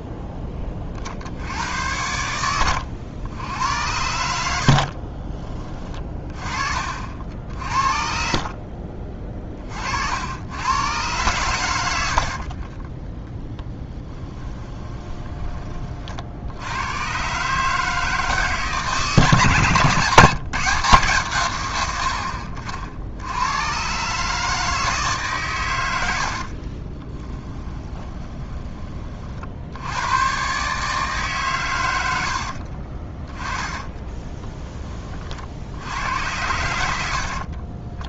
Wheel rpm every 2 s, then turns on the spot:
20, 90, 70, 40, 50, 100, 40, 20, 80, 160, 170, 80, 160, 60, 20, 140, 50, 20, 90.
8-10 12-16 26-28 32-34 36-38